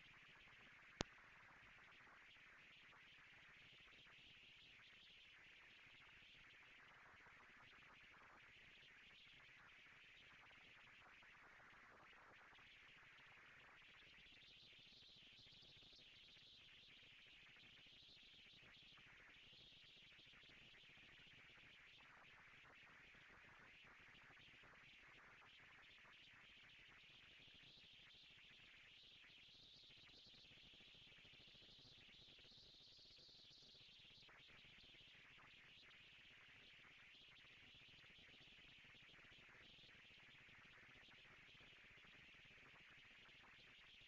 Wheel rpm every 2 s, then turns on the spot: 230, 230, 230, 230, 230, 230, 180, 160, 160, 220, 230, 230, 230, 230, 230, 230, 230, 230, 230, 230, 230, 230.
none